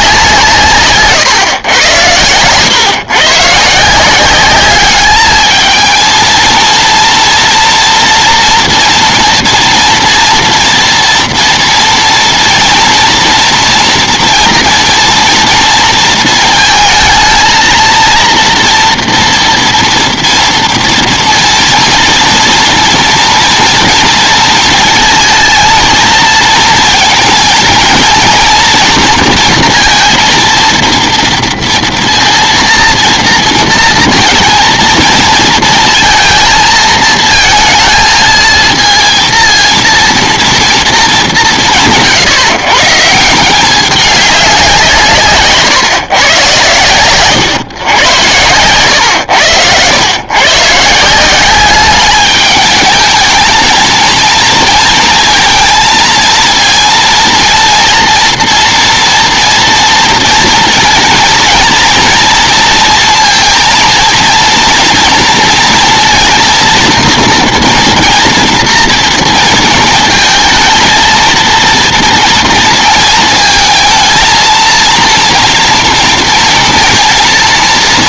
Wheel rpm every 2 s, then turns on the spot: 140, 120, 200, 230, 230, 230, 230, 230, 230, 240, 230, 230, 230, 230, 240, 230, 230, 230, 230, 220, 220, 150, 170, 120, 110, 150, 220, 230, 230, 230, 230, 230, 230, 230, 230, 230, 230, 230, 230.
none